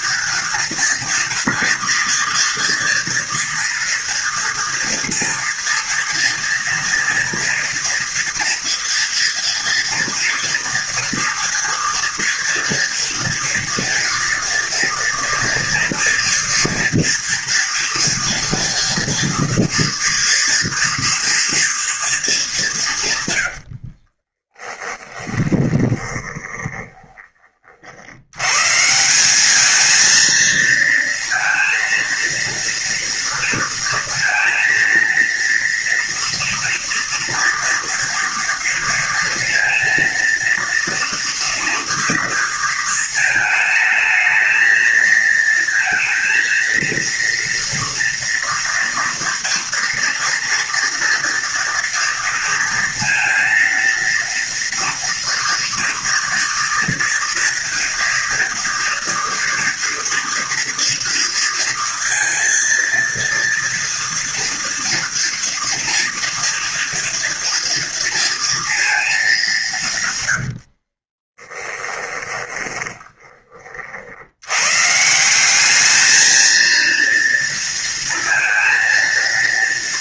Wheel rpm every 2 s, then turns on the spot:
230, 230, 230, 230, 230, 230, 230, 230, 230, 230, 240, 170, 10, 20, 130, 230, 230, 230, 230, 230, 230, 230, 220, 230, 230, 230, 230, 230, 230, 230, 230, 230, 230, 230, 230, 70, 20, 120, 230, 230.
24-28 70-74